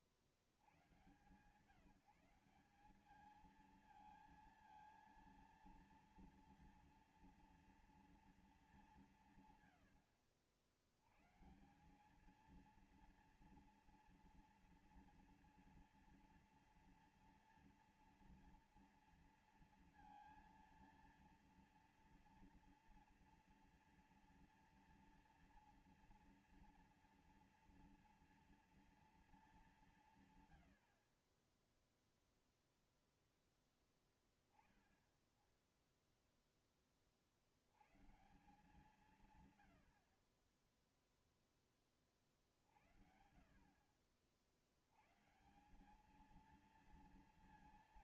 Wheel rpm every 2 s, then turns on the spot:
60, 190, 230, 230, 210, 80, 220, 230, 230, 230, 230, 240, 230, 240, 240, 110, 0, 0, 10, 160, 30, 50, 70, 220.
none